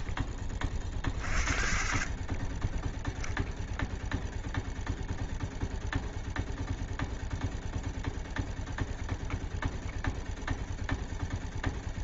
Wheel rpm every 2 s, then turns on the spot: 0, 0, 0, 0, 0, 0.
none